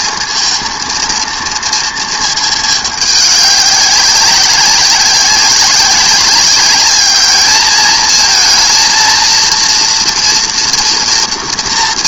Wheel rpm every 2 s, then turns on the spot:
230, 210, 190, 200, 230, 230.
none